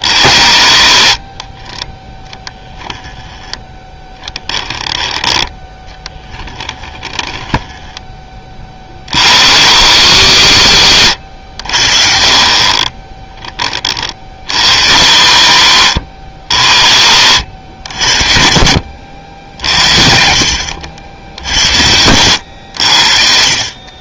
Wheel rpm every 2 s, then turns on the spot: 70, 10, 10, 20, 50, 100, 30, 70, 50, 60, 70, 80.
0-4 6-8 10-12